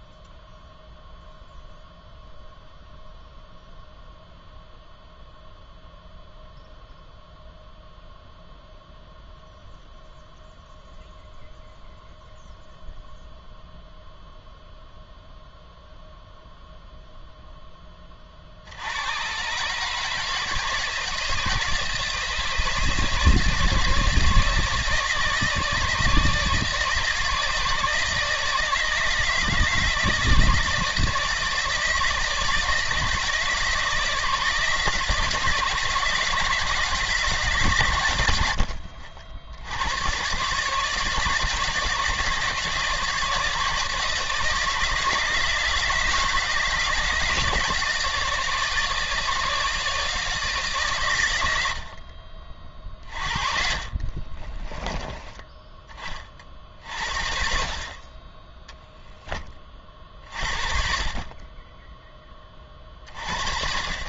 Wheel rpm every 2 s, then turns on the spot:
0, 0, 0, 0, 0, 0, 0, 0, 0, 60, 160, 150, 160, 160, 160, 160, 160, 160, 160, 80, 140, 160, 160, 160, 160, 140, 40, 20, 40, 10, 50, 30.
54-56